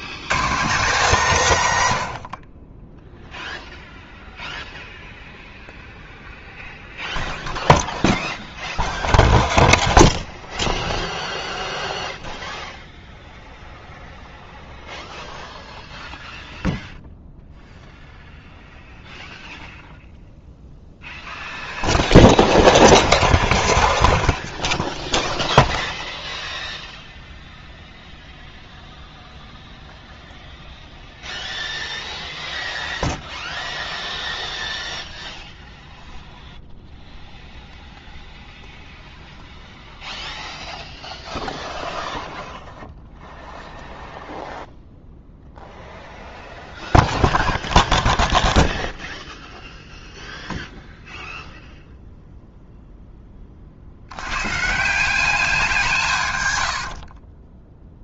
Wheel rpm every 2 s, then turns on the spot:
150, 30, 0, 0, 0, 0, 0, 0, 0, 0, 0, 0, 0, 0, 0, 0, 0, 0, 0, 0, 0, 0, 0, 0, 0, 0, 0, 140, 100.
56-58